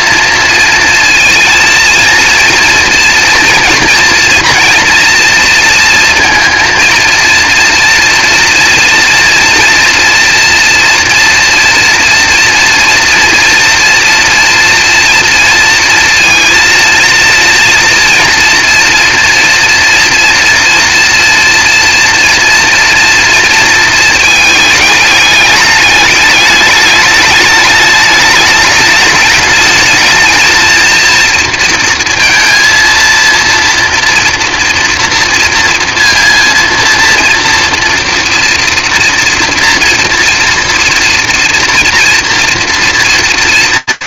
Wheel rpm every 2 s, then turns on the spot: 230, 230, 230, 230, 240, 230, 230, 230, 230, 230, 230, 230, 220, 210, 210, 230, 230, 230, 230, 230, 230, 230.
none